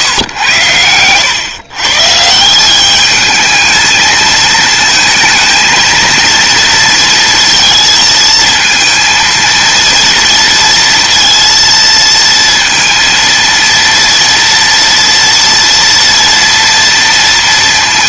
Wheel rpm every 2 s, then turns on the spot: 100, 190, 220, 230, 230, 230, 230, 230, 230.
none